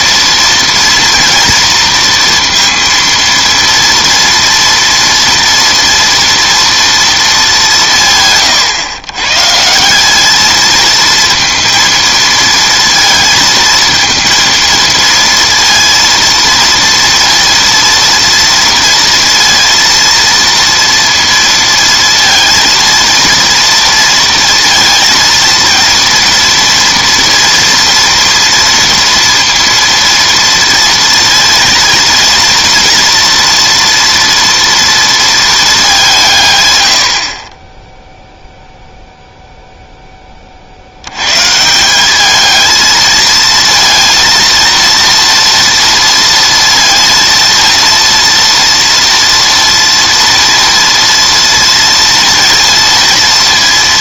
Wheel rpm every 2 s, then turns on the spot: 230, 230, 230, 230, 130, 220, 230, 230, 230, 230, 230, 230, 230, 230, 230, 230, 230, 230, 130, 0, 50, 220, 230, 230, 230, 230, 230.
none